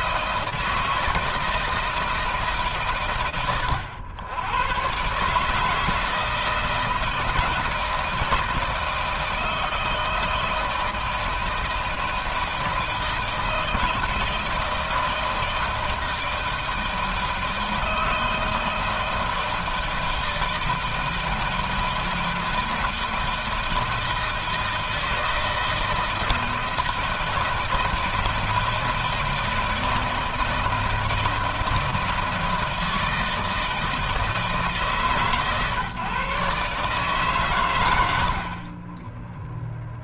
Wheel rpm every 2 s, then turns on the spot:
160, 130, 110, 160, 160, 160, 160, 160, 160, 160, 160, 160, 160, 160, 160, 160, 160, 140, 140, 30.
38-40